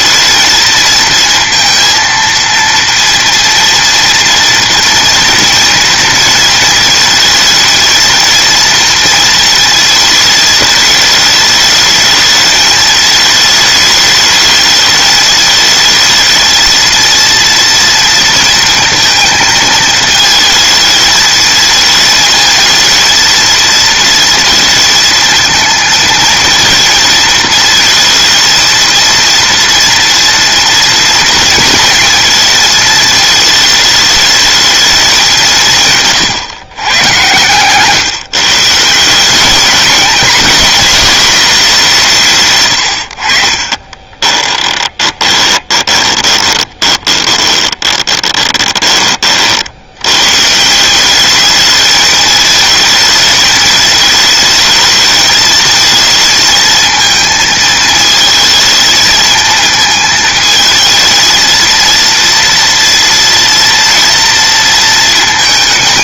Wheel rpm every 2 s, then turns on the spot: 220, 230, 230, 230, 220, 220, 210, 210, 220, 230, 220, 220, 230, 230, 220, 230, 220, 220, 140, 140, 210, 170, 20, 20, 20, 100, 210, 220, 220, 220, 220, 230, 230.
44-50